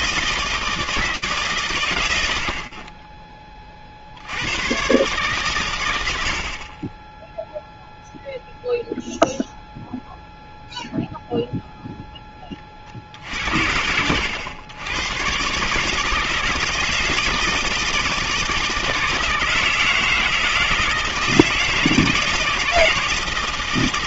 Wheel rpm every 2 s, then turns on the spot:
170, 60, 120, 40, 0, 0, 30, 100, 160, 160, 160, 170.
none